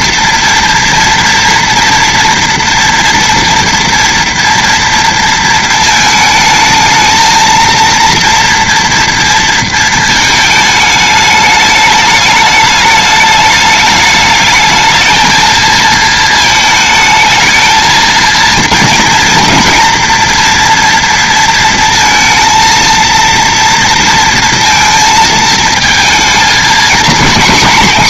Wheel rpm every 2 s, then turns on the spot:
230, 230, 230, 220, 230, 210, 210, 220, 220, 230, 230, 230, 220, 230.
none